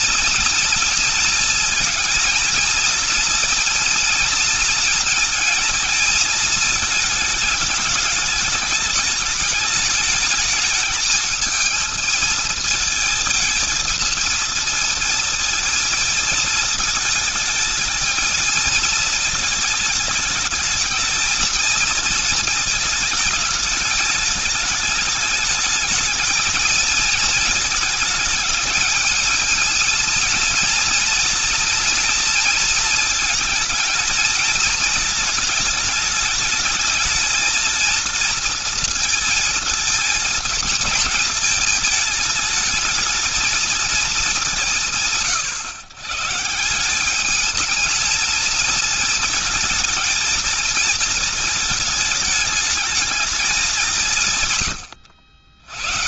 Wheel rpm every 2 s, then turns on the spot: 230, 230, 230, 220, 220, 220, 220, 230, 220, 220, 220, 220, 210, 220, 210, 230, 220, 220, 220, 230, 220, 220, 180, 170, 220, 220, 220, 110.
none